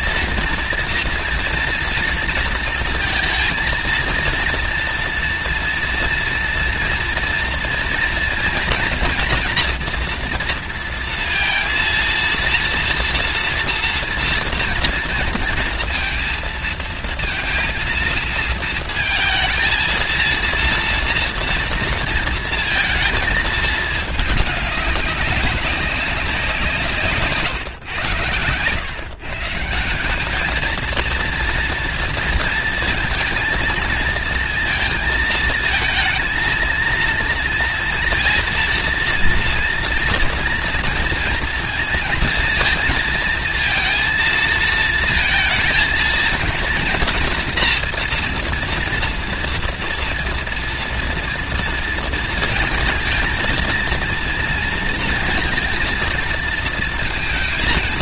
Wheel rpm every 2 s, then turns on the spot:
230, 230, 230, 230, 230, 230, 230, 230, 230, 230, 230, 230, 200, 170, 120, 220, 220, 230, 230, 230, 230, 230, 230, 230, 240, 230, 220, 230, 230.
none